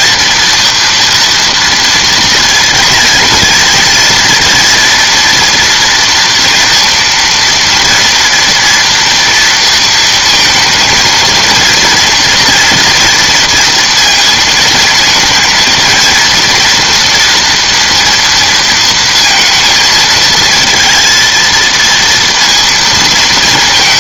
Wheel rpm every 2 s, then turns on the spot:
240, 230, 230, 230, 230, 230, 230, 230, 230, 230, 220, 230.
none